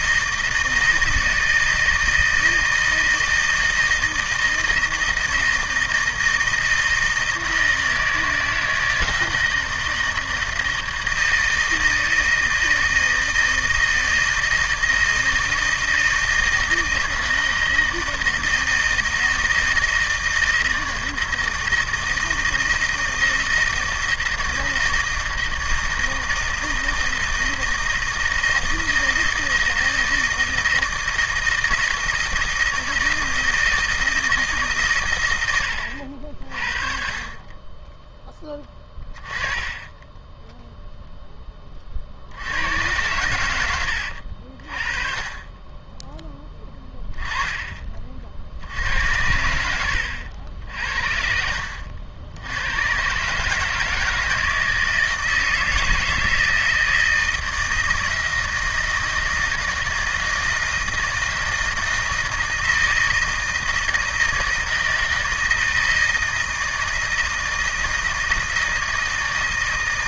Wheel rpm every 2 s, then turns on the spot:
160, 160, 160, 160, 160, 160, 160, 160, 160, 160, 160, 160, 160, 160, 160, 160, 160, 140, 40, 10, 0, 100, 40, 10, 60, 60, 90, 160, 160, 160, 160, 160, 160, 160, 160.
none